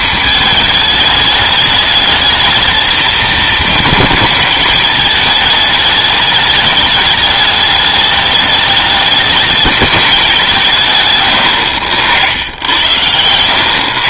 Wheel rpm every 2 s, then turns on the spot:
220, 220, 220, 210, 210, 170, 90.
none